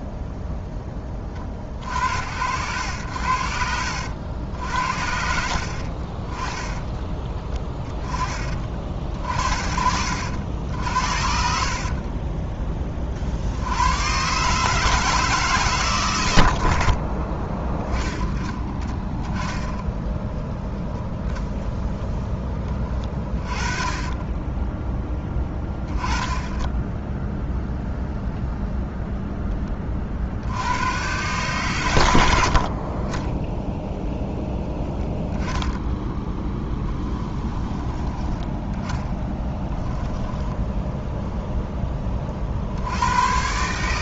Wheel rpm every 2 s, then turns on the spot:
10, 90, 70, 20, 50, 60, 30, 130, 40, 10, 0, 20, 20, 10, 0, 100, 40, 0, 10, 10, 10, 90.
6-8 22-24 36-38 40-42